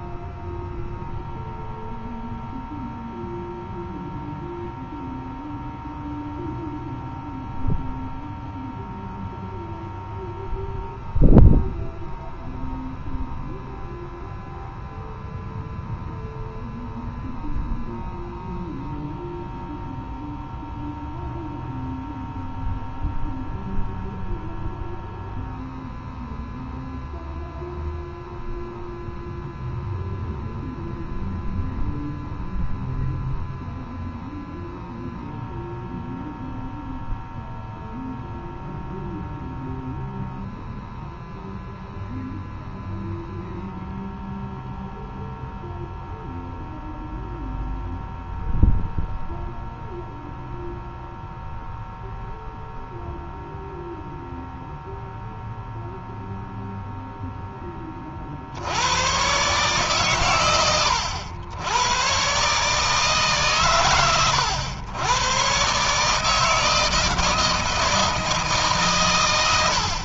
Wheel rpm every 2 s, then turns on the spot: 0, 0, 0, 0, 0, 0, 0, 0, 0, 0, 0, 0, 0, 0, 0, 0, 0, 0, 0, 0, 0, 0, 0, 0, 0, 0, 0, 0, 0, 120, 90, 140, 110, 160, 110.
none